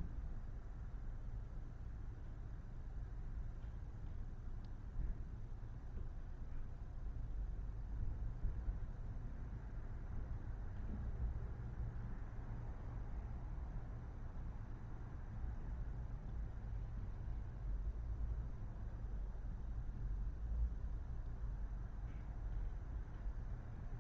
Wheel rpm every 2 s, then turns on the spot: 0, 0, 0, 0, 0, 0, 0, 0, 0, 0, 0, 0.
none